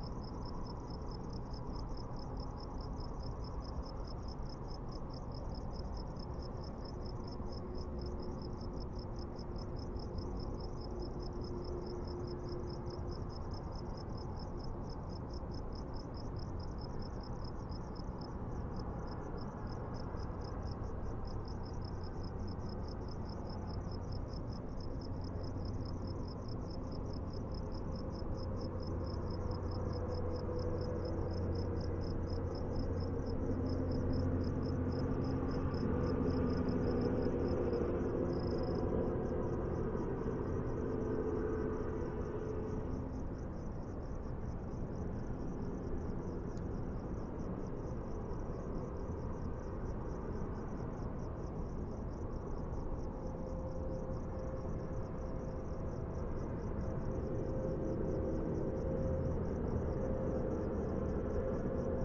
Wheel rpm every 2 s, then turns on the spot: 0, 0, 0, 0, 0, 0, 0, 0, 0, 0, 0, 0, 0, 0, 0, 0, 0, 0, 0, 0, 0, 0, 0, 0, 0, 0, 0, 0, 0, 0, 0.
none